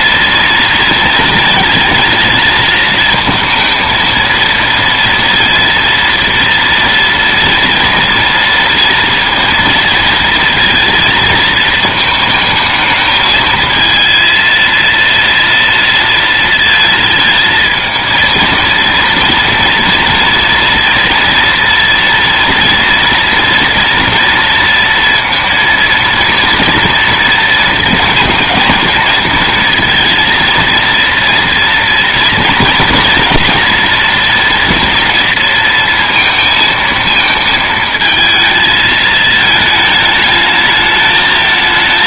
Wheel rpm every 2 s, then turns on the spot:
230, 230, 230, 230, 230, 230, 220, 230, 230, 230, 240, 230, 230, 230, 230, 230, 230, 230, 220, 220, 220.
none